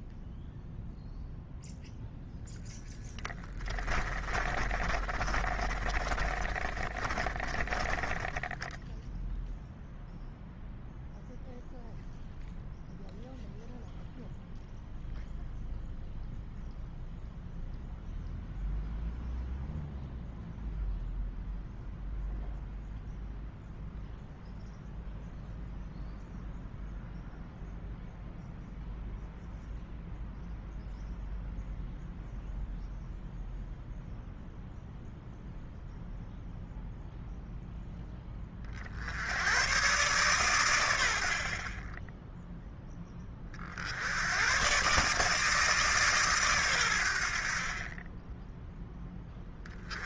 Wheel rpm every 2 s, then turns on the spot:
0, 0, 30, 30, 10, 0, 0, 0, 0, 0, 0, 0, 0, 0, 0, 0, 0, 0, 0, 40, 110, 10, 130, 110, 10.
4-10